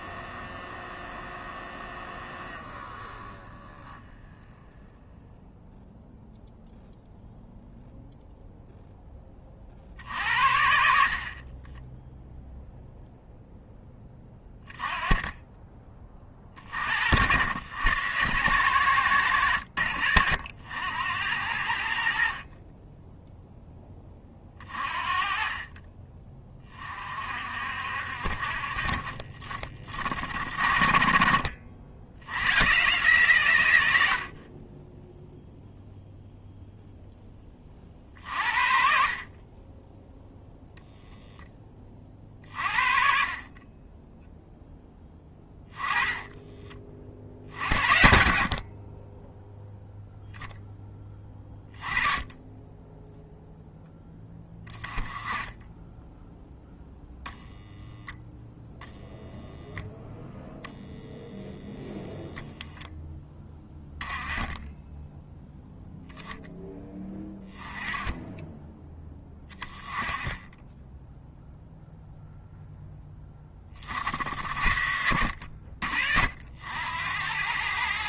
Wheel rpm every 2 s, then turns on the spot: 0, 0, 0, 0, 0, 60, 0, 20, 50, 110, 80, 10, 30, 30, 40, 40, 130, 20, 0, 50, 0, 40, 10, 30, 40, 10, 10, 20, 0, 0, 0, 10, 10, 10, 10, 10, 10, 80, 80.
none